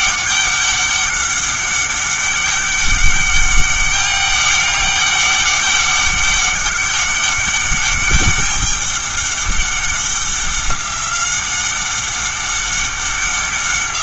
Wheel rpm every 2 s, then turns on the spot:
200, 200, 200, 200, 200, 190, 190.
none